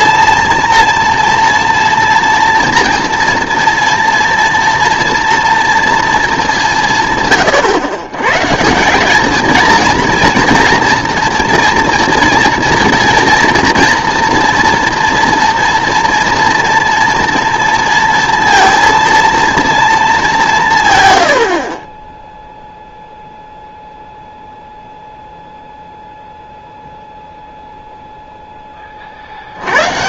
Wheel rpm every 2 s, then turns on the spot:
230, 230, 230, 190, 150, 230, 230, 230, 230, 230, 170, 0, 0, 0, 20.
none